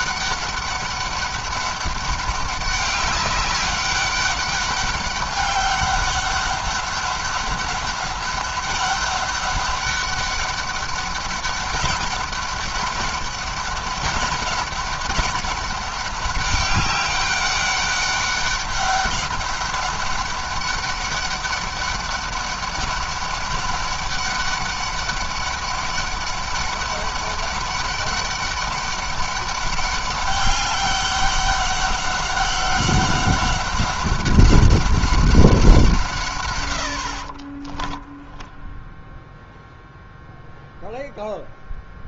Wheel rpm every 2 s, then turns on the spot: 200, 200, 200, 200, 200, 200, 200, 200, 200, 200, 200, 200, 200, 200, 200, 200, 190, 190, 100, 0, 0.
36-38